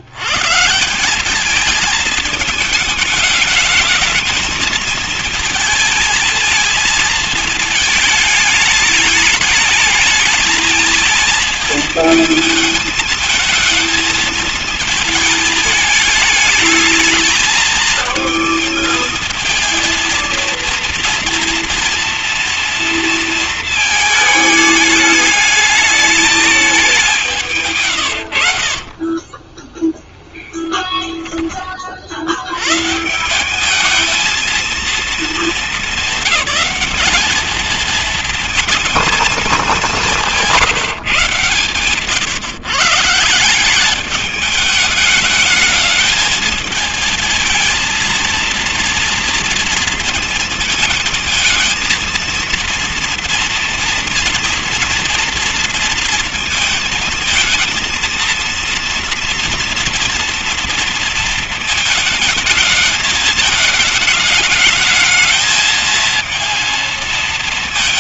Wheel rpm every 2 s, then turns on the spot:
170, 210, 230, 230, 220, 220, 220, 220, 220, 220, 230, 230, 210, 200, 50, 10, 150, 230, 210, 220, 150, 150, 210, 220, 230, 220, 230, 240, 230, 230, 230, 220, 220, 230.
28-30